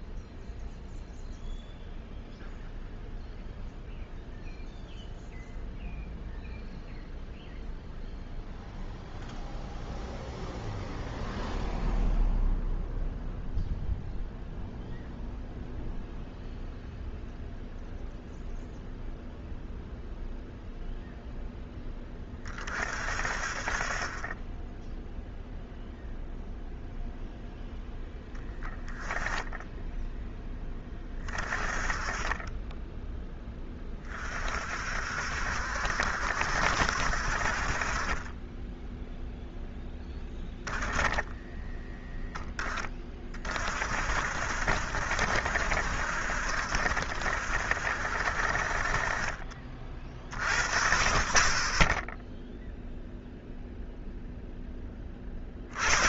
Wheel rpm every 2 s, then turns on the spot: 0, 0, 0, 0, 0, 0, 0, 0, 0, 0, 0, 40, 10, 0, 10, 20, 10, 50, 80, 10, 10, 20, 70, 70, 40, 20, 0, 10.
40-42